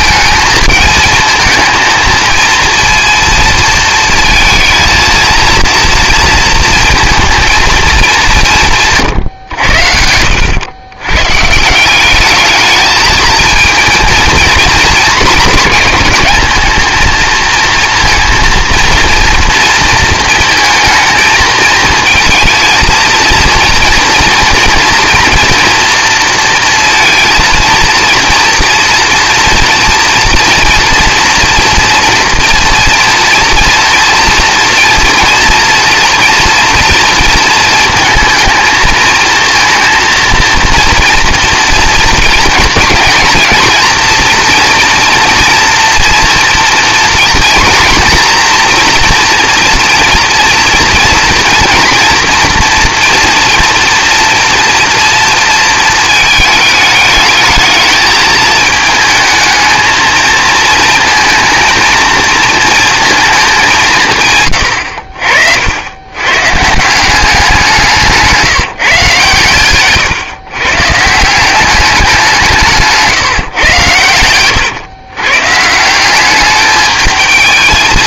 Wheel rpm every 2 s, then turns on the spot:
220, 230, 230, 230, 160, 100, 210, 220, 220, 230, 220, 230, 240, 230, 230, 230, 230, 240, 230, 220, 230, 230, 230, 230, 240, 230, 230, 230, 210, 220, 230, 230, 80, 170, 140, 140, 150, 120, 220.
8-10